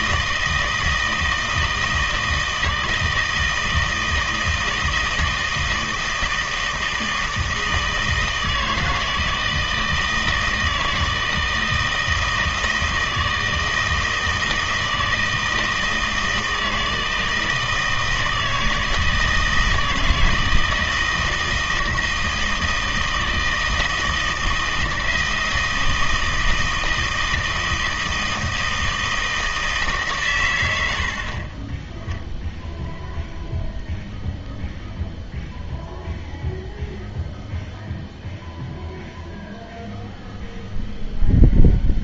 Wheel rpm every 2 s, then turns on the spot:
160, 160, 160, 160, 160, 160, 160, 160, 160, 160, 160, 160, 160, 160, 160, 100, 0, 0, 0, 0, 0.
none